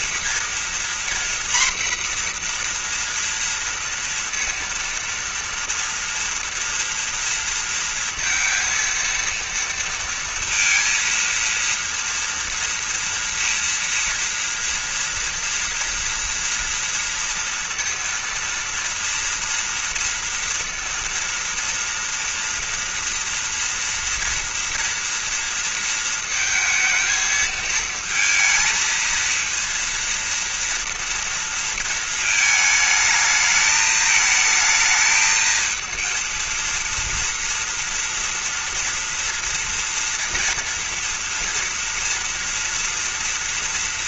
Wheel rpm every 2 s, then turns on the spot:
240, 240, 230, 230, 230, 230, 230, 230, 230, 230, 230, 230, 230, 230, 220, 230, 220, 220, 230, 230, 240, 230.
none